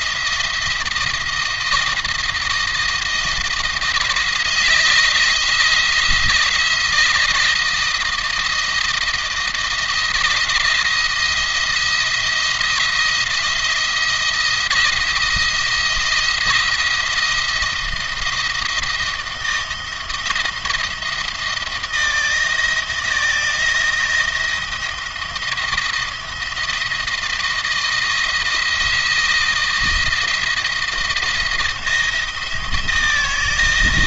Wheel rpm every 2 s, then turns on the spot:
170, 170, 160, 160, 170, 170, 170, 170, 170, 160, 160, 160, 170, 170, 170, 170, 160.
none